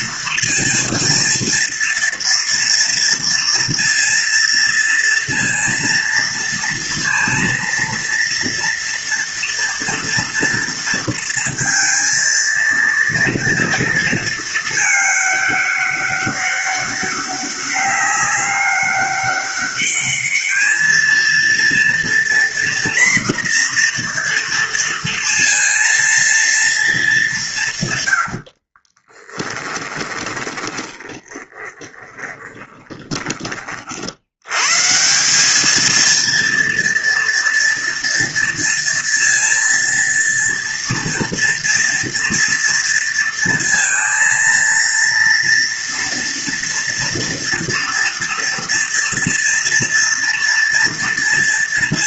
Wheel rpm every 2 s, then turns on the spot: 230, 230, 230, 230, 230, 230, 230, 220, 200, 200, 220, 240, 230, 220, 40, 20, 20, 140, 230, 230, 230, 230, 230, 230, 230, 230.
28-34